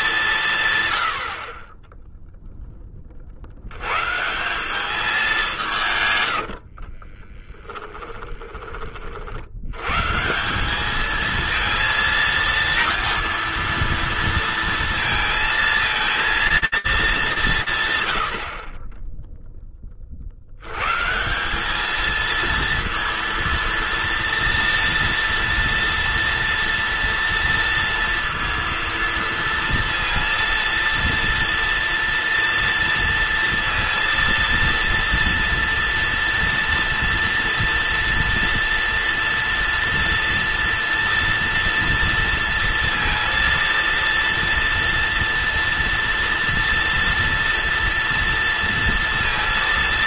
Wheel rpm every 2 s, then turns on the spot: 110, 30, 200, 30, 40, 210, 230, 230, 210, 20, 140, 230, 230, 230, 230, 230, 230, 230, 230, 230, 230, 230, 230, 230, 230.
6-8